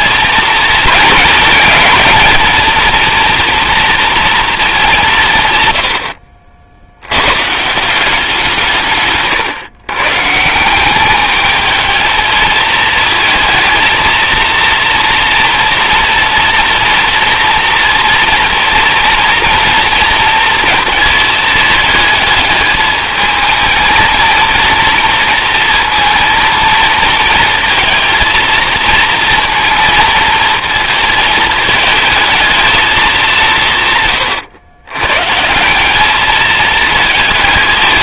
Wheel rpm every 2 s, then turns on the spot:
230, 220, 200, 60, 170, 170, 220, 230, 230, 240, 230, 220, 230, 220, 230, 230, 220, 100, 220.
none